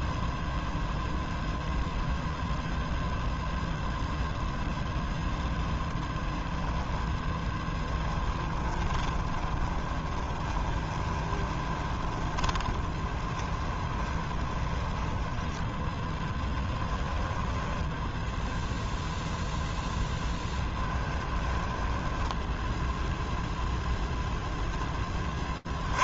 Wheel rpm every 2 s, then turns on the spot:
0, 0, 0, 0, 10, 20, 20, 20, 10, 0, 10, 0, 10.
8-18 20-22